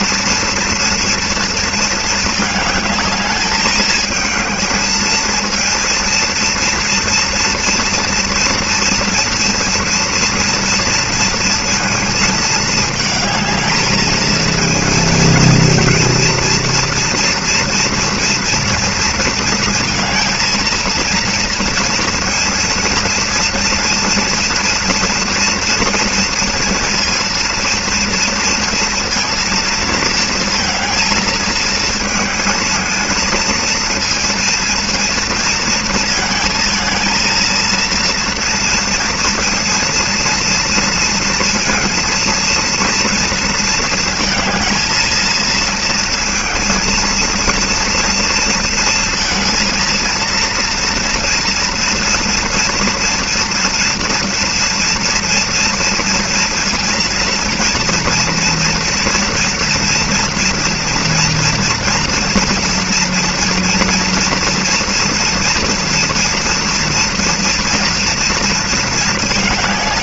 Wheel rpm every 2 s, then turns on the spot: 230, 220, 220, 230, 230, 230, 220, 230, 230, 230, 230, 230, 240, 230, 230, 230, 220, 230, 230, 230, 230, 230, 220, 230, 230, 230, 230, 230, 230, 230, 230, 230, 240, 230, 230.
none